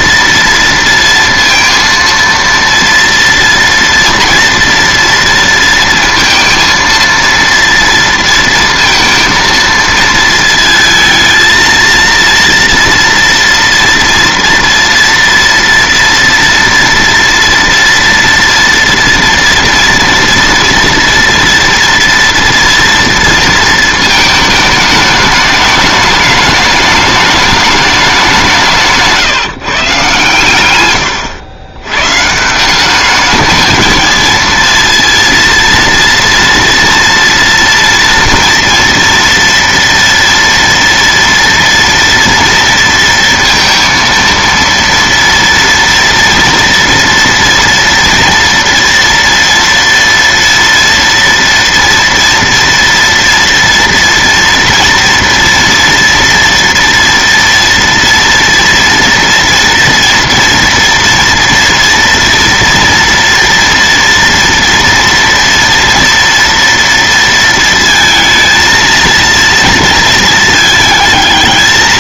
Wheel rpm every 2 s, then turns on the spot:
230, 230, 230, 230, 230, 220, 230, 230, 230, 230, 230, 230, 210, 210, 150, 110, 210, 230, 230, 230, 230, 230, 230, 230, 230, 230, 230, 230, 240, 230, 230, 230, 230, 230, 230, 220.
28-30